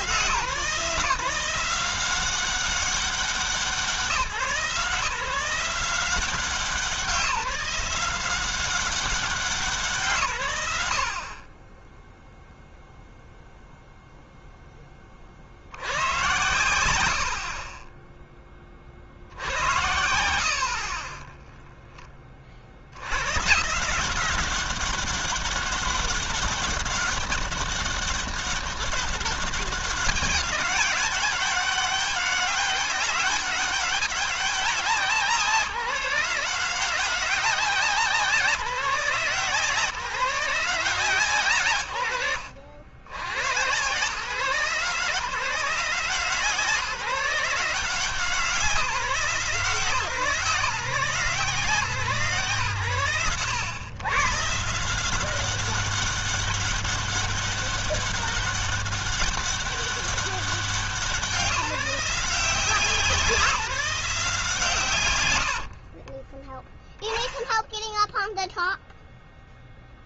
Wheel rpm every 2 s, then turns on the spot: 170, 190, 170, 180, 190, 90, 0, 20, 90, 60, 30, 90, 200, 200, 200, 200, 200, 180, 180, 160, 150, 80, 160, 170, 170, 160, 110, 170, 200, 200, 190, 180, 140, 0, 0.
none